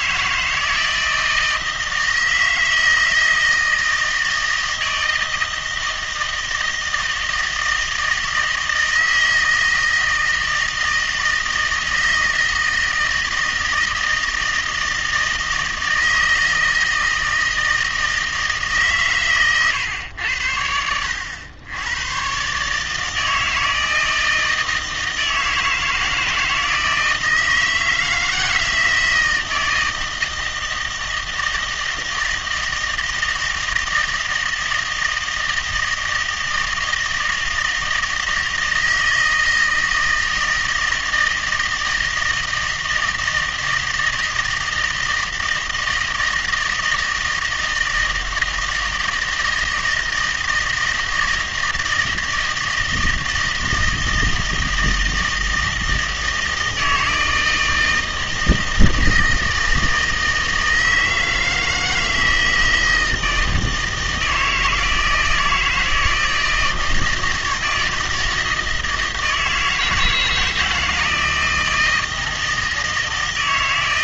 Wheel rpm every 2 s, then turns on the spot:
160, 160, 160, 160, 160, 160, 160, 160, 160, 150, 90, 140, 160, 160, 160, 160, 160, 160, 160, 160, 160, 160, 160, 160, 160, 160, 160, 160, 160, 160, 160, 160, 160, 160, 160, 160, 160.
none